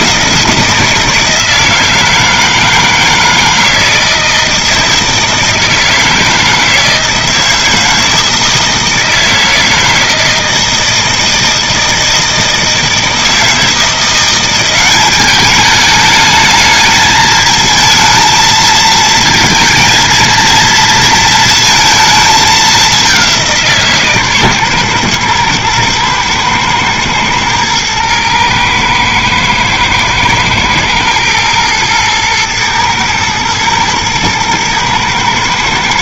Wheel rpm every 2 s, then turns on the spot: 170, 160, 160, 160, 160, 160, 160, 180, 220, 220, 230, 210, 130, 110, 110, 110, 110, 110.
none